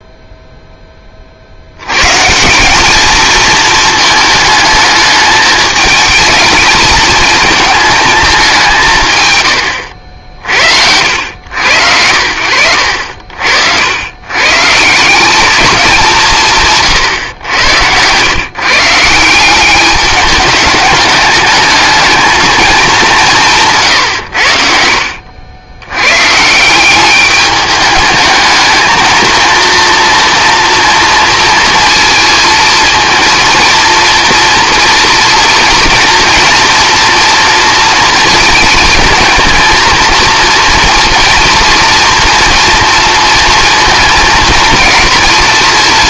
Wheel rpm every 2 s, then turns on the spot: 10, 190, 220, 210, 180, 70, 80, 150, 150, 150, 210, 220, 70, 170, 220, 230, 230, 230, 230, 230, 230, 240, 230.
none